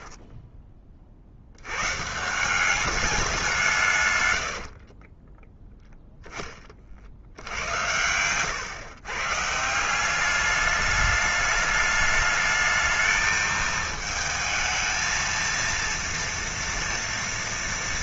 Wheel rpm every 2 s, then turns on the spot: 20, 200, 60, 30, 120, 210, 220, 220, 230.
4-6